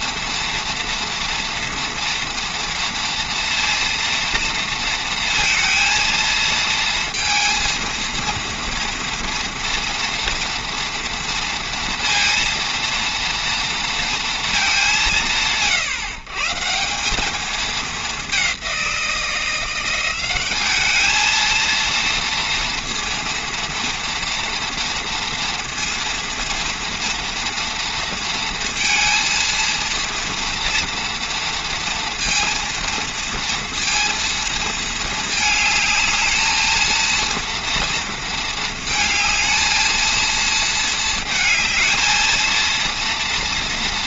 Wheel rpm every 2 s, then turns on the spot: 240, 230, 230, 230, 230, 230, 230, 160, 150, 190, 190, 230, 230, 230, 230, 230, 230, 230, 220, 220, 230, 230.
none